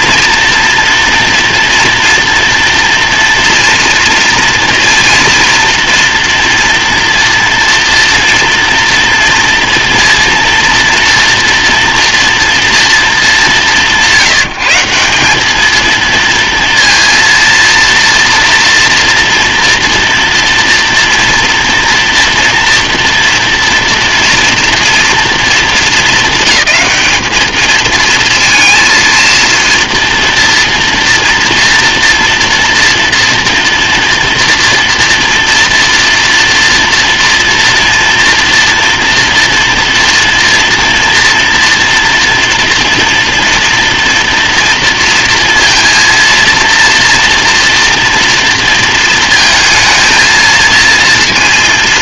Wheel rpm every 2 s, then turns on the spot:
230, 230, 230, 230, 230, 230, 230, 170, 230, 230, 240, 230, 240, 220, 220, 230, 230, 230, 230, 230, 230, 230, 230, 230, 230, 230.
none